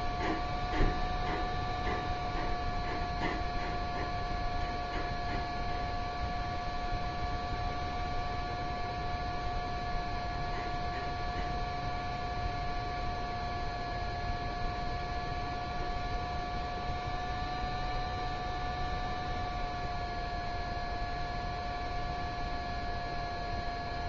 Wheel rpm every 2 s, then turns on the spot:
0, 0, 0, 0, 0, 0, 0, 0, 0, 0, 0, 0.
none